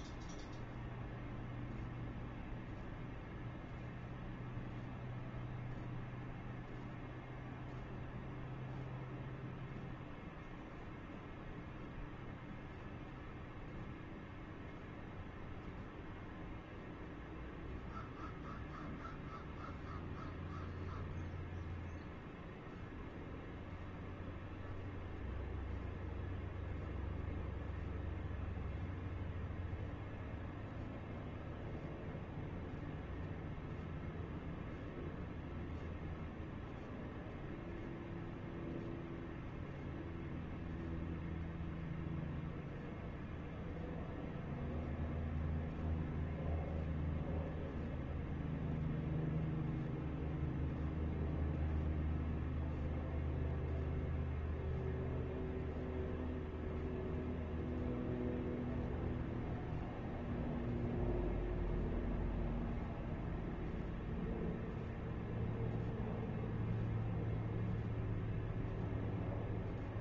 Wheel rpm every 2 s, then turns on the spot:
0, 0, 0, 0, 0, 0, 0, 0, 0, 0, 0, 0, 0, 0, 0, 0, 0, 0, 0, 0, 0, 0, 0, 0, 0, 0, 0, 0, 0, 0, 0, 0, 0, 0, 0.
none